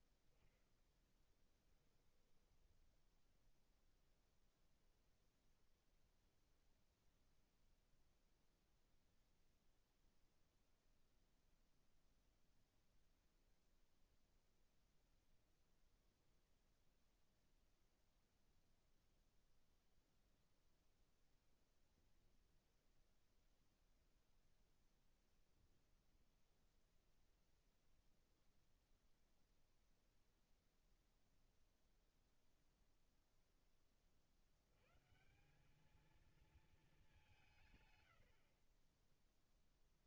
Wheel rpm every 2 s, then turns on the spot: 60, 30, 10, 10, 0, 0, 0, 0, 0, 0, 0, 0, 0, 0, 0, 0, 0, 60, 220, 70.
2-6